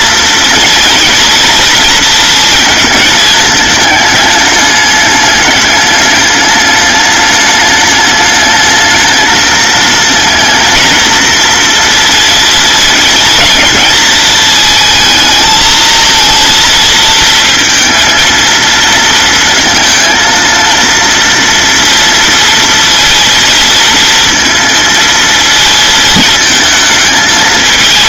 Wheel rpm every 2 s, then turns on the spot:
230, 220, 210, 210, 210, 230, 230, 220, 230, 230, 230, 230, 230, 220.
none